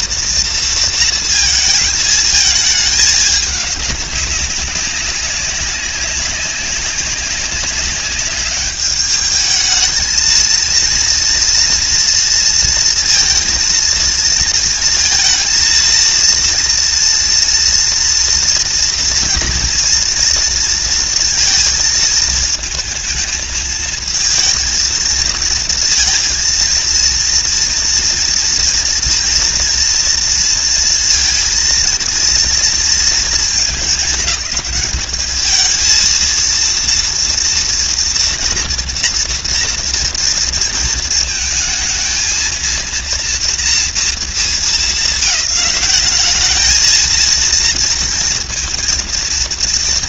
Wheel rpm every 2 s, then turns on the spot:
230, 220, 200, 200, 210, 230, 230, 230, 230, 230, 230, 220, 230, 230, 230, 230, 230, 210, 230, 230, 220, 230, 200, 230, 220.
none